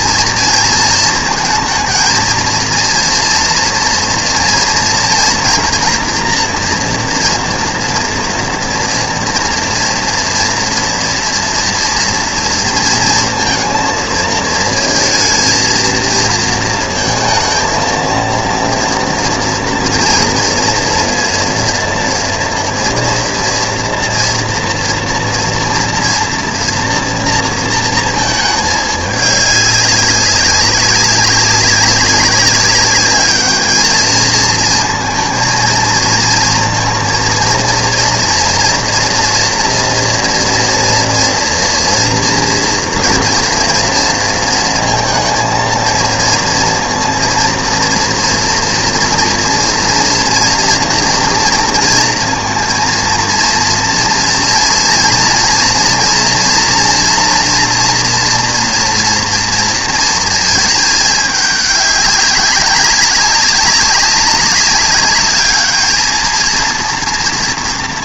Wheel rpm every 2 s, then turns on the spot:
230, 230, 230, 240, 230, 230, 230, 220, 230, 230, 230, 230, 230, 240, 210, 200, 200, 220, 230, 230, 230, 240, 230, 230, 240, 230, 230, 230, 240, 240, 220, 190, 200, 230.
none